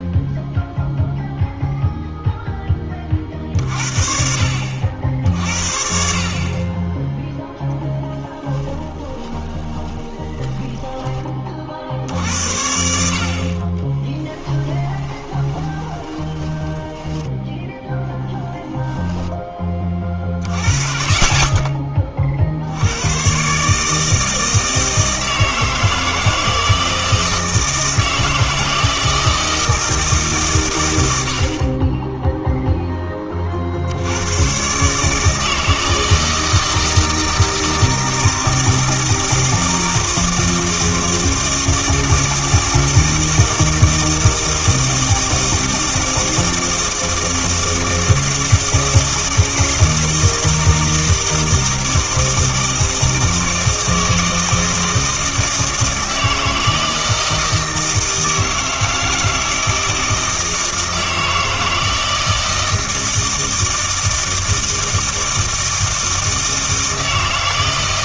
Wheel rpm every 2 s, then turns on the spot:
0, 10, 60, 30, 10, 20, 70, 10, 10, 10, 40, 60, 160, 160, 160, 120, 0, 130, 160, 160, 160, 160, 160, 160, 160, 160, 160, 160, 160, 160, 160, 160, 160, 160.
8-12 14-18